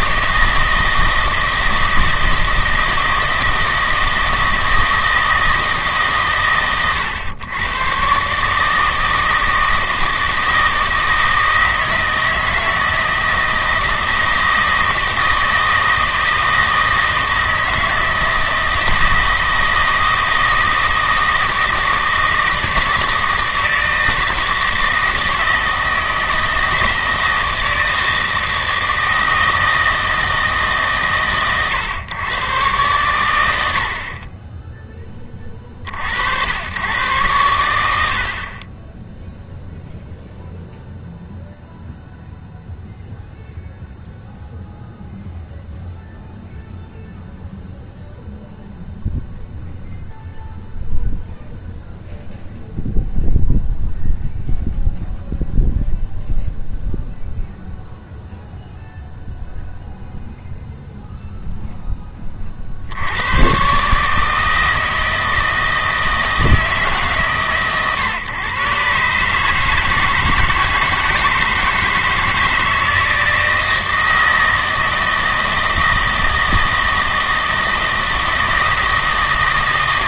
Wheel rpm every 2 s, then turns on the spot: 160, 160, 160, 100, 150, 160, 160, 160, 160, 160, 160, 160, 160, 160, 160, 140, 110, 20, 110, 20, 0, 0, 0, 0, 0, 0, 0, 0, 0, 0, 0, 60, 160, 140, 130, 160, 160, 160, 160, 160.
none